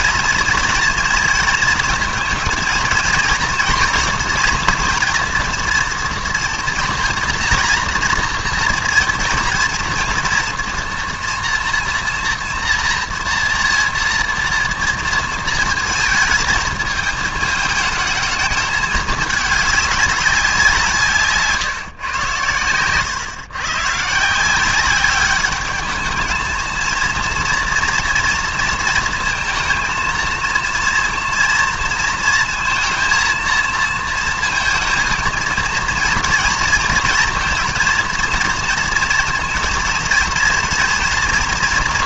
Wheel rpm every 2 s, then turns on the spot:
230, 230, 230, 230, 230, 240, 230, 230, 220, 210, 180, 110, 180, 220, 230, 230, 230, 230, 230, 230, 230.
none